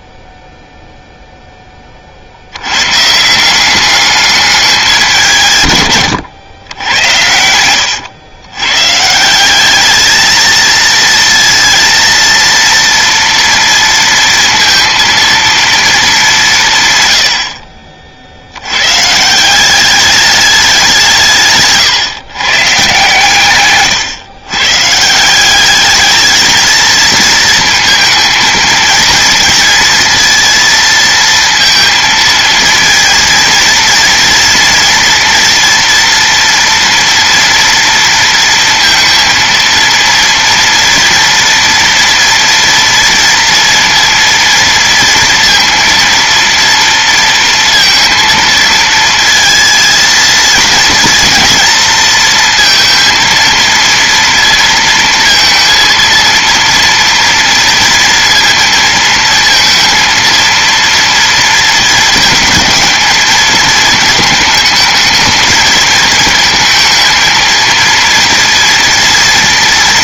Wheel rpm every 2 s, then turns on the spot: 0, 100, 200, 100, 140, 230, 230, 230, 140, 120, 170, 140, 160, 230, 230, 230, 230, 230, 230, 230, 230, 230, 230, 230, 220, 240, 230, 230, 230, 230, 230, 220, 220, 220, 230.
none